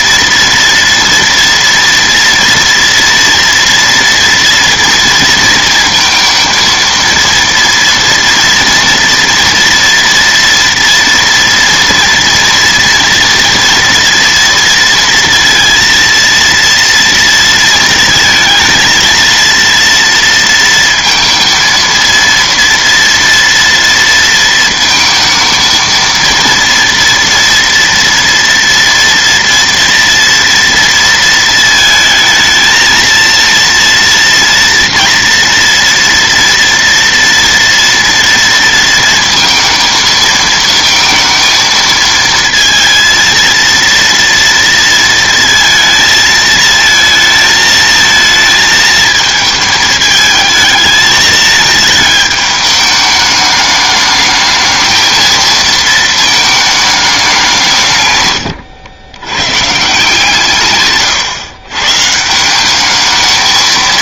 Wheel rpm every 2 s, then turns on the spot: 230, 230, 230, 230, 230, 230, 230, 230, 230, 230, 230, 230, 230, 230, 230, 230, 220, 230, 230, 230, 220, 230, 230, 220, 220, 220, 210, 220, 220, 100, 140, 200.
none